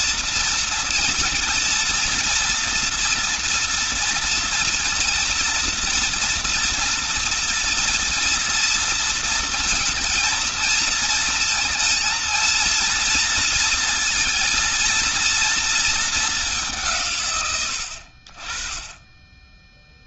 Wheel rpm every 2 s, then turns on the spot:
230, 230, 230, 230, 230, 230, 230, 230, 190, 40.
none